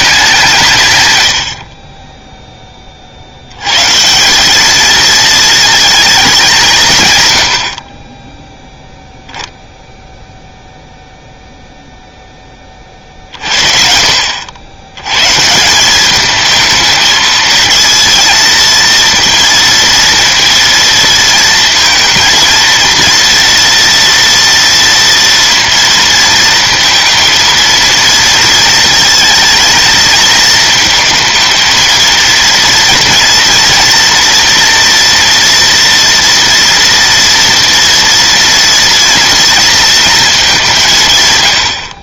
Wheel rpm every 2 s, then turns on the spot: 150, 30, 220, 150, 0, 0, 30, 100, 220, 230, 230, 230, 230, 230, 230, 220, 230, 230, 230, 230, 170.
none